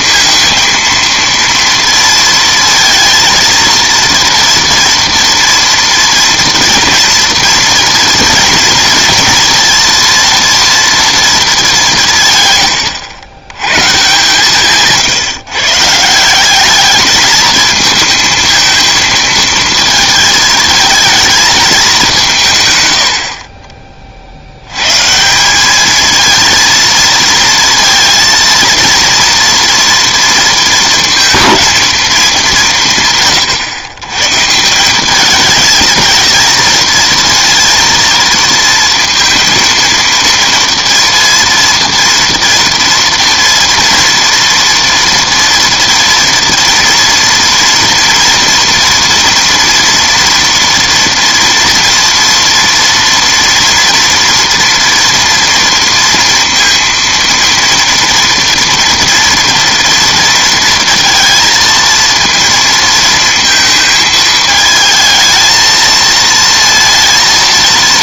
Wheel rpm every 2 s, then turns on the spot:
230, 230, 230, 230, 230, 230, 110, 150, 200, 220, 230, 130, 110, 230, 230, 230, 180, 170, 230, 230, 230, 230, 230, 230, 230, 230, 230, 230, 230, 230, 230, 230, 220, 230.
none